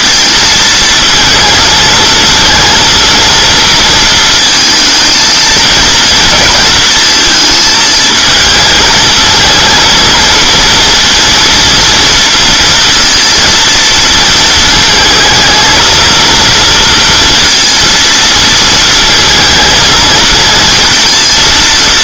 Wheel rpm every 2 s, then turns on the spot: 230, 230, 220, 230, 220, 230, 230, 220, 230, 220, 230.
none